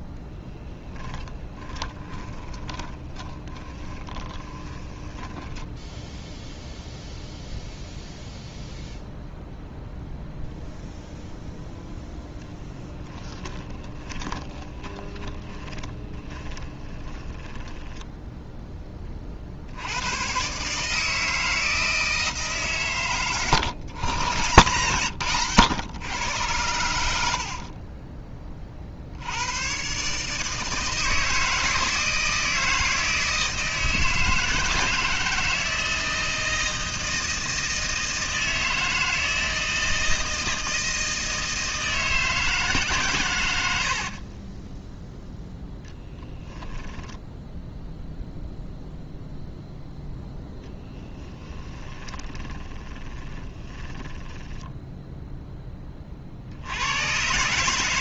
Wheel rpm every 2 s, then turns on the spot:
10, 20, 20, 0, 0, 0, 10, 20, 20, 10, 150, 140, 130, 90, 50, 160, 160, 160, 160, 160, 160, 130, 10, 10, 0, 10, 20, 10, 90.
0-6 12-18 44-48 50-56